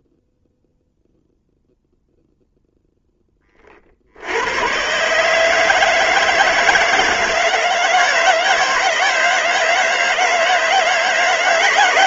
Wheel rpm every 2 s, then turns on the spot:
0, 10, 130, 160, 160, 160.
none